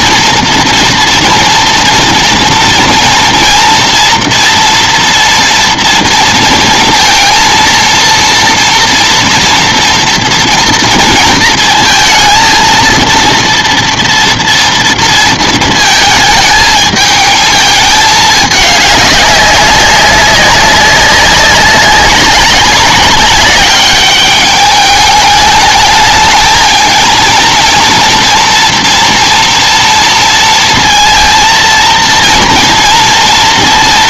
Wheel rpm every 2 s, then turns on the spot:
230, 230, 230, 230, 230, 220, 230, 230, 220, 200, 190, 200, 210, 230, 230, 230, 230.
none